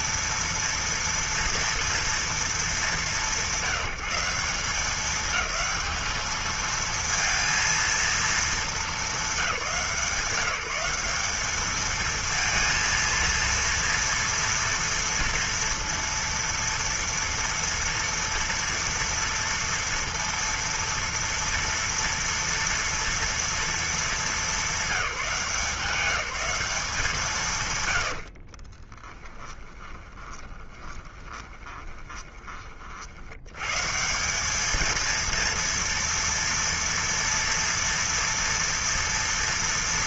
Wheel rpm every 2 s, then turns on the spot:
230, 200, 190, 230, 220, 180, 230, 230, 230, 230, 230, 230, 200, 190, 80, 20, 20, 180, 230, 230.
28-34